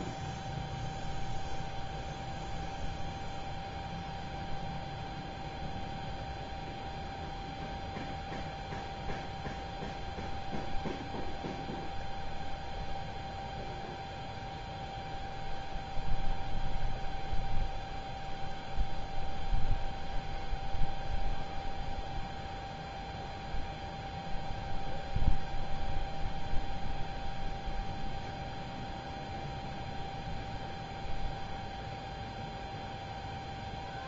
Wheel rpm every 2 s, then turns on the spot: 0, 0, 0, 0, 0, 0, 0, 0, 0, 0, 0, 0, 0, 0, 0, 0, 0.
none